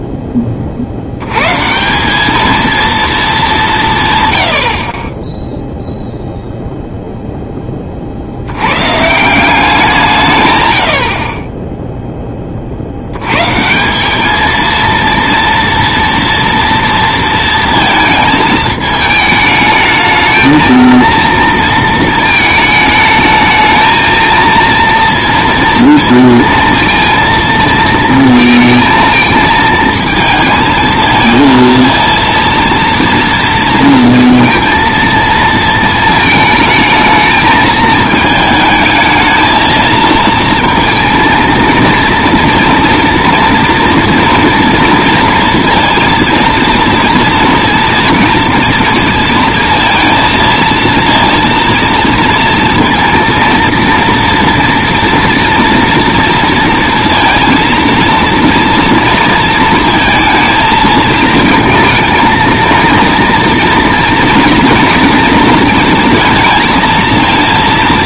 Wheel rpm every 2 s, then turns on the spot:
80, 220, 30, 0, 160, 50, 90, 230, 230, 220, 230, 210, 230, 230, 230, 230, 230, 230, 220, 220, 230, 230, 230, 230, 230, 230, 230, 230, 230, 230, 220, 230, 230, 230.
none